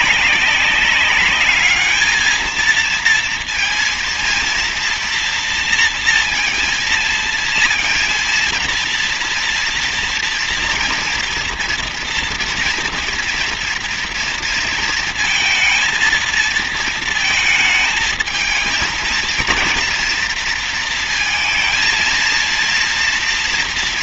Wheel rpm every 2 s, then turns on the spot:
200, 220, 230, 230, 230, 230, 230, 230, 230, 220, 230, 230.
none